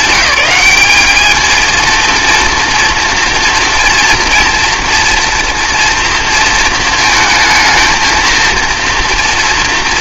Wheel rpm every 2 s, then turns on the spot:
200, 230, 230, 230, 230.
none